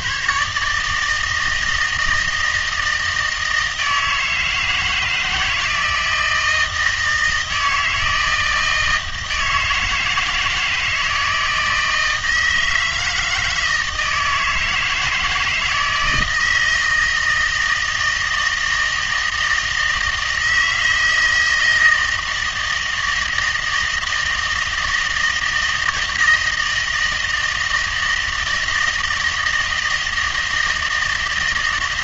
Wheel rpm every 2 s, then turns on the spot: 140, 160, 160, 160, 160, 160, 160, 160, 160, 160, 160, 160, 160, 160, 160, 160.
none